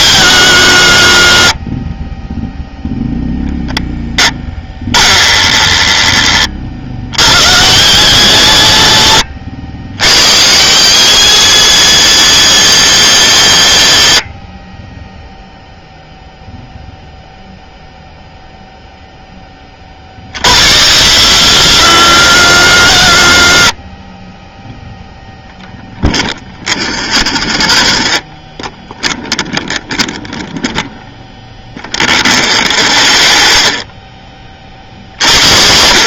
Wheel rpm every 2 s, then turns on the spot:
90, 0, 10, 30, 90, 160, 230, 50, 0, 0, 60, 80, 0, 0, 0, 0, 0, 40.
none